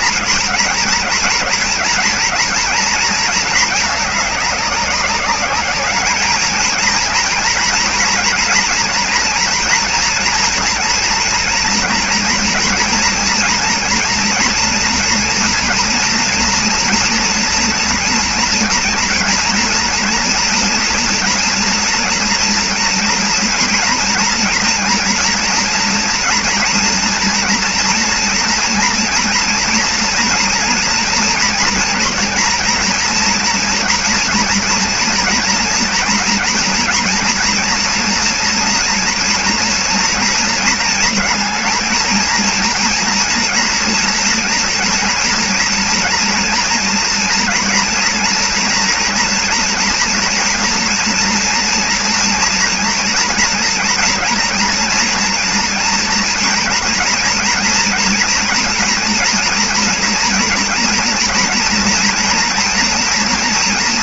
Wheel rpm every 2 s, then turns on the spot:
230, 230, 200, 220, 230, 230, 230, 240, 230, 230, 240, 230, 240, 230, 230, 230, 230, 240, 240, 240, 230, 230, 230, 230, 230, 230, 230, 230, 230, 230, 230, 230.
none